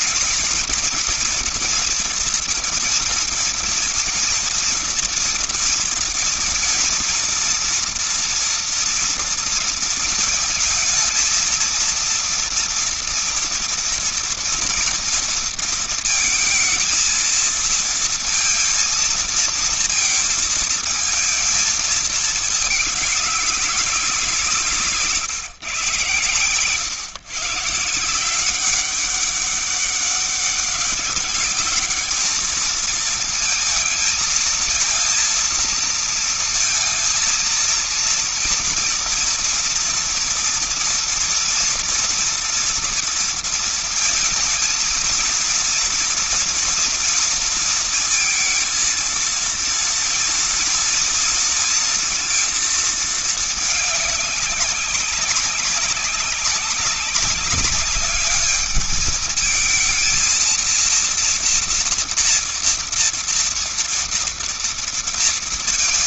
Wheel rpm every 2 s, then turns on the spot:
230, 230, 230, 230, 230, 220, 230, 230, 220, 230, 230, 220, 180, 120, 180, 200, 220, 220, 230, 230, 240, 230, 230, 230, 230, 240, 230, 200, 200, 210, 230, 230, 230.
none